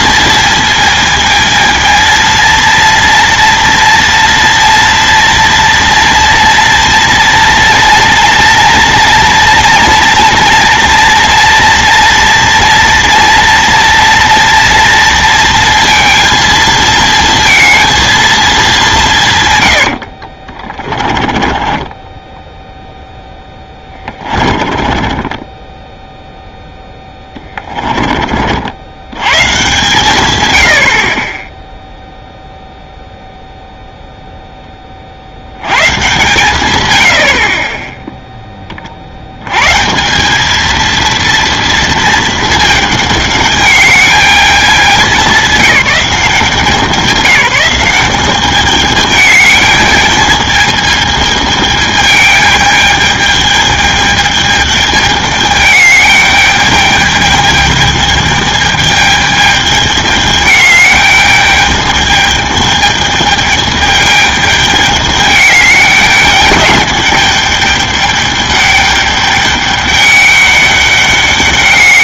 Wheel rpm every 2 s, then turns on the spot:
230, 230, 230, 230, 230, 240, 230, 230, 230, 210, 30, 0, 20, 0, 70, 80, 0, 10, 130, 30, 220, 220, 210, 180, 210, 210, 210, 210, 210, 210, 210, 210, 210, 210, 210, 200.
20-22 24-26